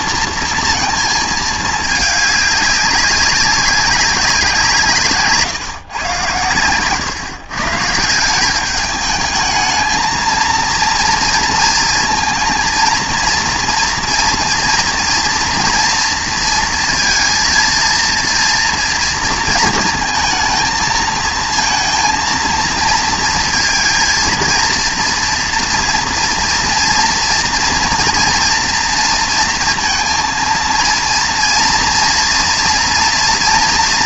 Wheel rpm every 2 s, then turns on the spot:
230, 200, 170, 110, 200, 230, 230, 230, 230, 230, 220, 230, 230, 230, 230, 230, 230.
none